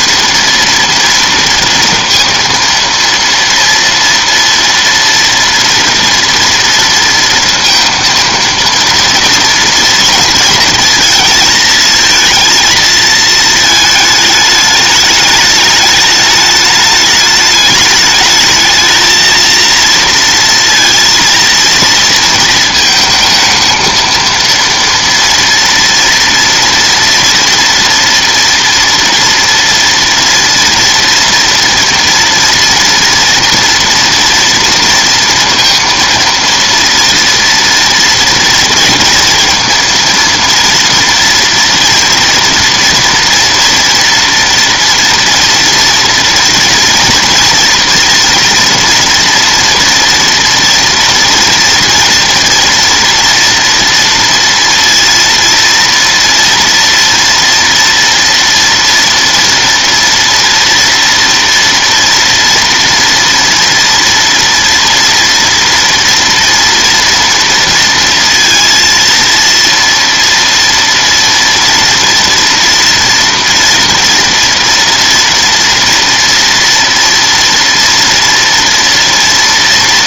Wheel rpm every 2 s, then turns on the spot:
230, 230, 230, 230, 230, 230, 230, 210, 210, 220, 230, 220, 230, 230, 230, 230, 230, 230, 230, 240, 230, 230, 230, 240, 240, 230, 230, 230, 230, 230, 230, 230, 230, 230, 230, 230, 230, 230, 240, 230.
none